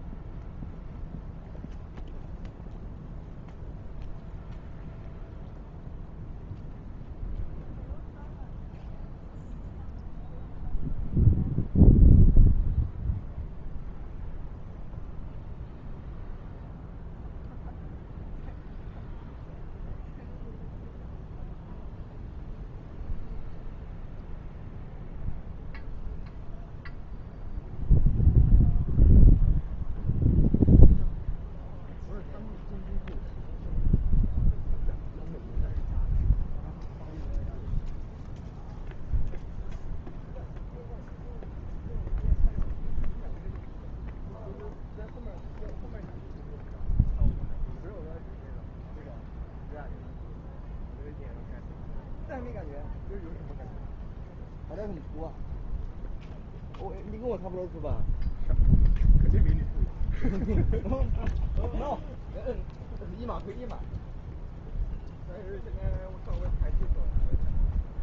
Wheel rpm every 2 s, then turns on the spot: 0, 0, 0, 0, 0, 0, 0, 0, 0, 0, 0, 0, 0, 0, 0, 0, 0, 0, 0, 0, 0, 0, 0, 0, 0, 0, 0, 0, 0, 0, 0, 0, 0, 0.
none